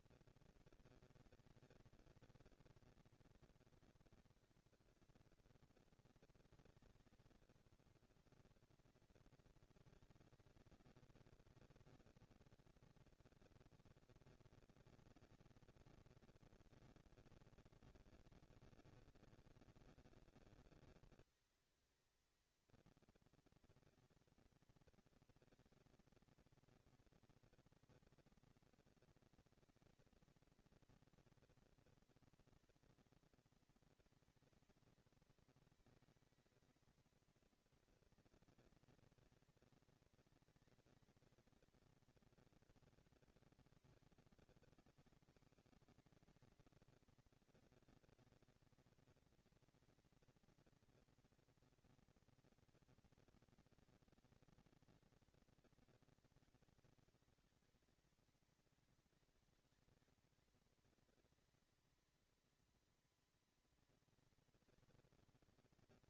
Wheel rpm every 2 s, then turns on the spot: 230, 230, 230, 230, 230, 230, 230, 230, 230, 200, 200, 220, 230, 230, 230, 230, 230, 220, 220, 230, 230, 220, 220, 230, 230, 240, 230, 230, 220, 220, 210, 220, 220.
none